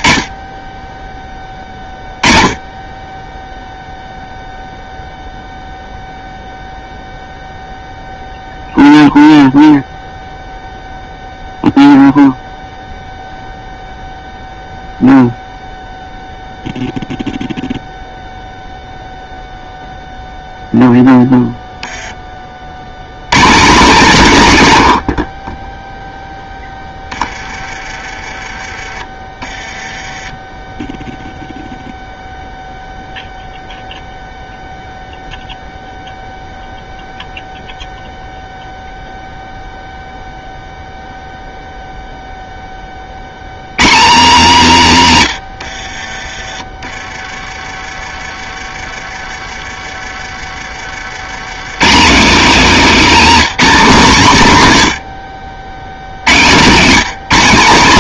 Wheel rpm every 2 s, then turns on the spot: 10, 10, 0, 0, 0, 0, 0, 0, 0, 0, 0, 80, 100, 20, 20, 10, 0, 0, 0, 0, 0, 10, 180, 20, 30, 50, 220, 130, 160.
24-28